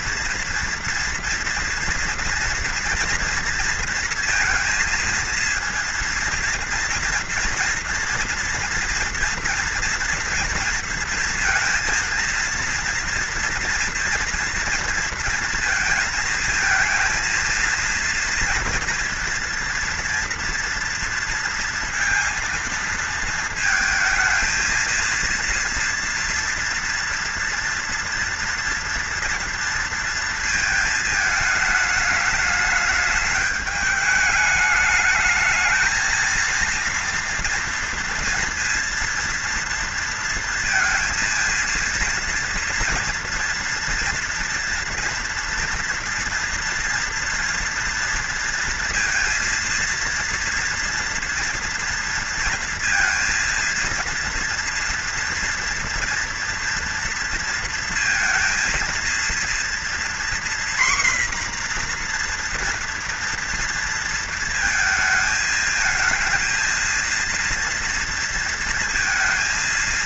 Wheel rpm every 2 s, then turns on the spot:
230, 230, 230, 230, 230, 230, 230, 230, 230, 230, 230, 230, 230, 230, 230, 220, 210, 210, 230, 230, 230, 230, 230, 230, 230, 230, 230, 230, 240, 230, 250, 240, 220, 230, 230.
none